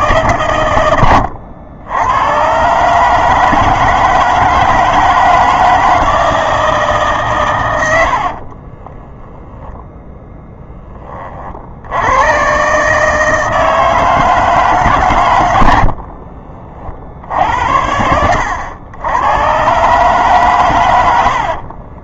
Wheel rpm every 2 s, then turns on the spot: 110, 140, 160, 150, 10, 20, 140, 150, 50, 100, 110.
8-10